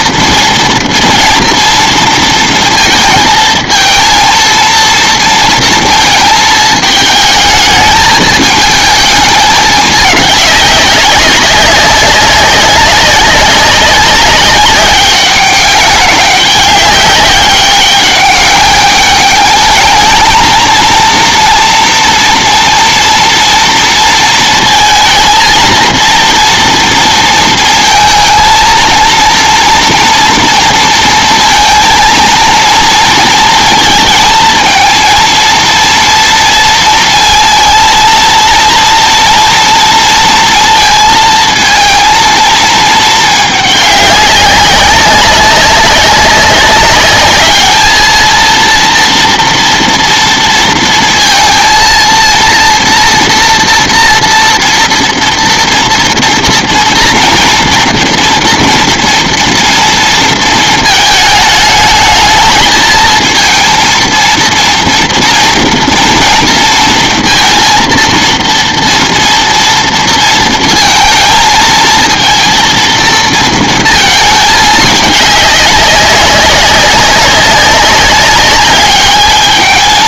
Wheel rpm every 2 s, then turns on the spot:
230, 230, 230, 220, 220, 200, 200, 190, 200, 200, 230, 240, 220, 230, 230, 230, 230, 230, 230, 230, 230, 220, 200, 200, 230, 230, 230, 230, 230, 230, 220, 220, 230, 230, 230, 230, 230, 210, 190, 200.
none